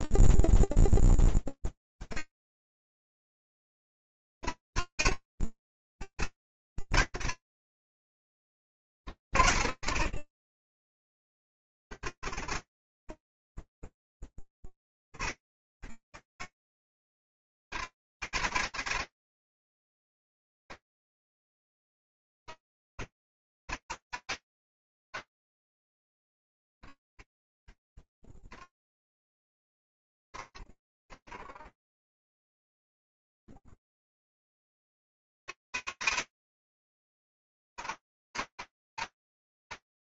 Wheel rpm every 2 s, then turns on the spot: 0, 180, 170, 140, 160, 100, 60, 40, 190, 220, 200, 200, 100, 20, 10, 60, 10, 290, 160, 210.
10-14 28-32